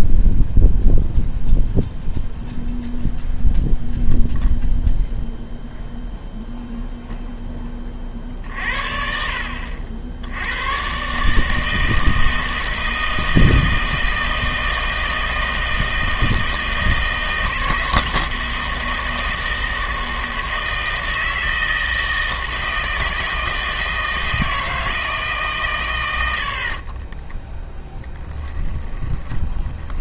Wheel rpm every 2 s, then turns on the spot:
0, 0, 0, 0, 50, 110, 160, 160, 160, 170, 160, 160, 160, 50, 20.
26-30